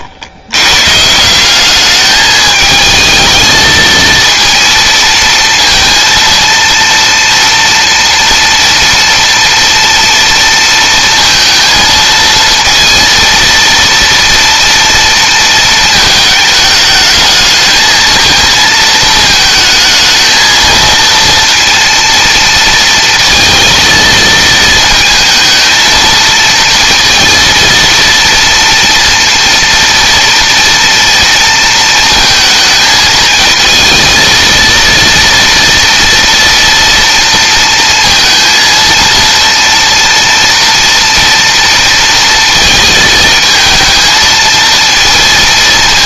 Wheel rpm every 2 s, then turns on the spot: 130, 220, 230, 230, 230, 230, 230, 230, 220, 220, 230, 230, 220, 230, 230, 230, 220, 230, 230, 230, 240, 230, 230.
none